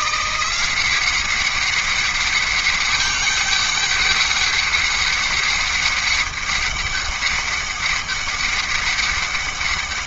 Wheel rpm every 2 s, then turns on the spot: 190, 200, 200, 200, 200.
none